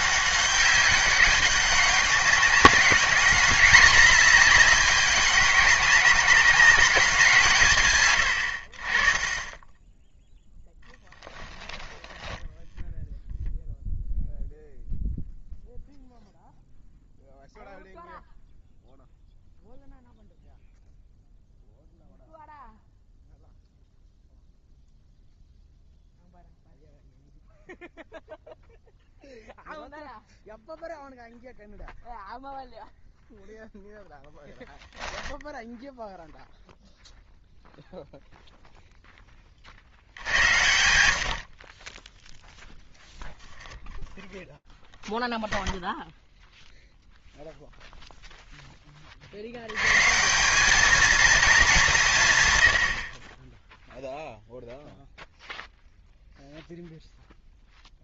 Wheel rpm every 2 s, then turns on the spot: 200, 200, 200, 200, 60, 0, 0, 0, 0, 0, 0, 0, 0, 0, 0, 0, 0, 10, 0, 0, 90, 0, 0, 0, 10, 210, 100, 0, 0.
none